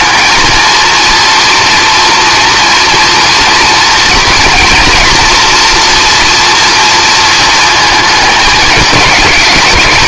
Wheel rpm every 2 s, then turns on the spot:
220, 230, 230, 230, 210.
none